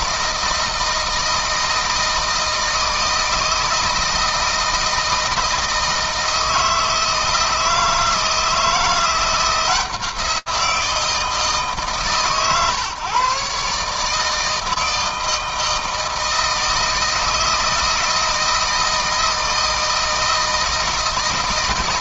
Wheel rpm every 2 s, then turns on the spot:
160, 160, 160, 160, 170, 170, 120, 160, 160, 160, 160.
none